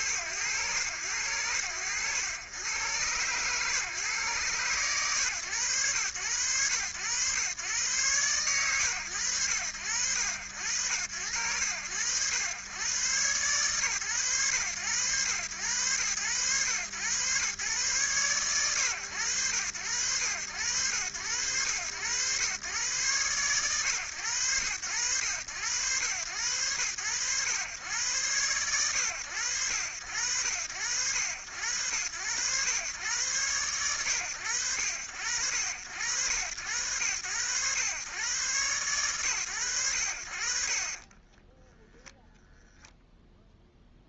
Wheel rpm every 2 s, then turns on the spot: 70, 100, 120, 100, 120, 80, 110, 110, 100, 120, 90, 120, 110, 90, 110, 90, 100, 100, 90, 120, 90, 0.
none